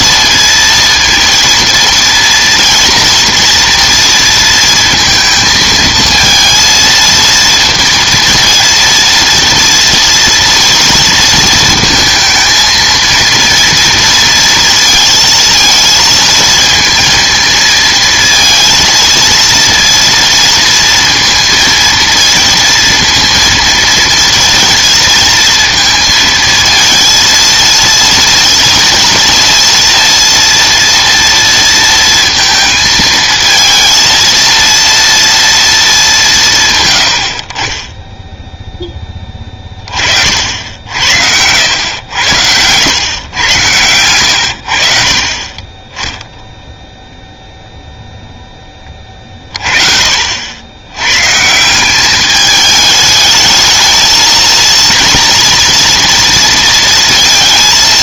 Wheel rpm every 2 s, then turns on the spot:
230, 230, 230, 230, 230, 230, 230, 230, 230, 220, 230, 230, 230, 220, 230, 230, 220, 230, 140, 10, 60, 90, 70, 0, 10, 80, 210, 230, 230.
none